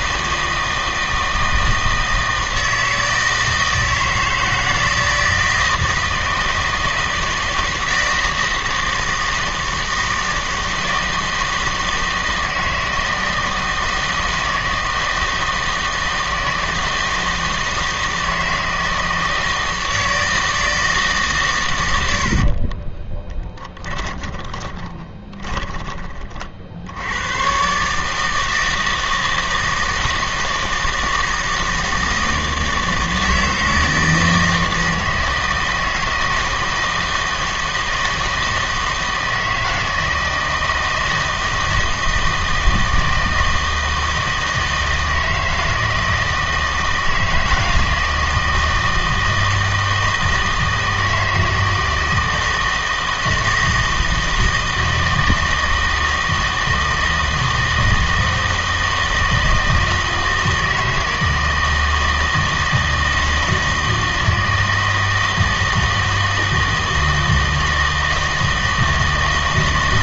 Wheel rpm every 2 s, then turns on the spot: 160, 160, 160, 160, 160, 160, 160, 160, 160, 160, 160, 40, 30, 60, 160, 160, 160, 160, 160, 160, 160, 160, 160, 160, 160, 160, 160, 160, 160, 160, 160, 160, 160, 160, 160.
22-26